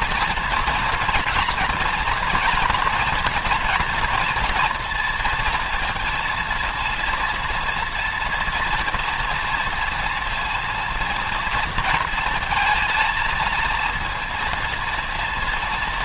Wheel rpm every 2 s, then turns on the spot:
240, 230, 230, 230, 230, 230, 230, 230.
none